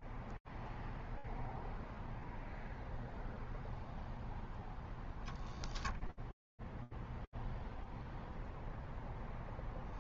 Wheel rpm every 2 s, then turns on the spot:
0, 0, 0, 0, 30.
none